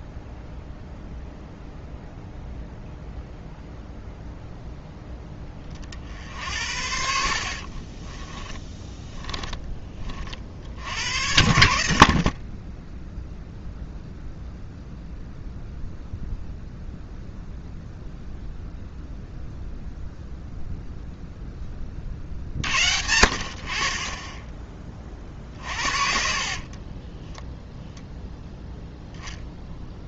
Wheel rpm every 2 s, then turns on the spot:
0, 0, 0, 70, 20, 60, 40, 0, 0, 0, 0, 60, 20, 40, 0.
8-10 26-28